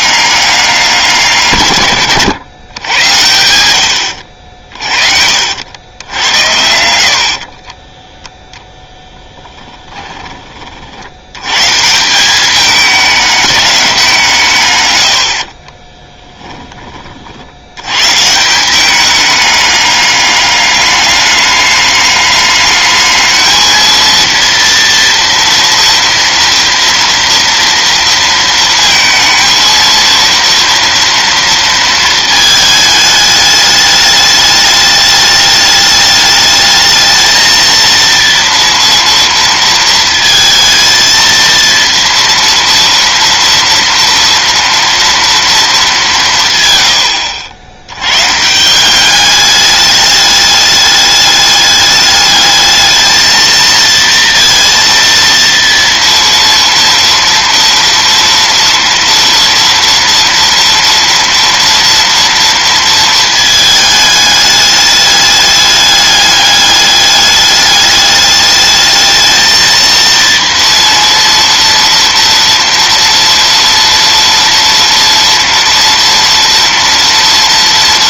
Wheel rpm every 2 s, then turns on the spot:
190, 120, 60, 80, 0, 40, 200, 140, 10, 180, 200, 210, 230, 230, 230, 230, 220, 210, 220, 230, 230, 230, 230, 130, 170, 210, 220, 230, 230, 230, 230, 230, 210, 210, 210, 230, 230, 230, 230.
4-6